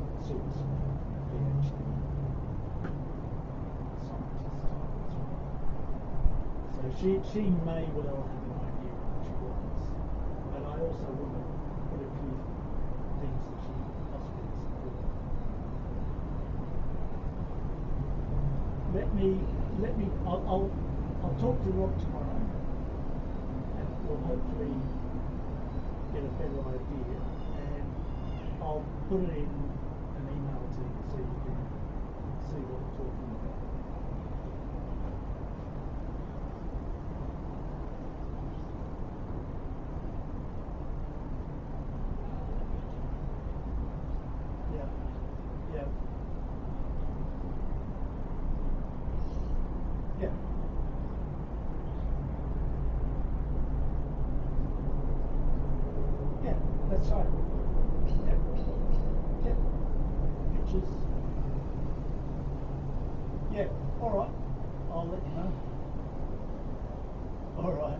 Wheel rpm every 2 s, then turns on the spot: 0, 0, 0, 0, 0, 0, 0, 0, 0, 0, 0, 0, 0, 0, 0, 0, 0, 0, 0, 0, 0, 0, 0, 0, 0, 0, 0, 0, 0, 0, 0, 0, 0, 0.
none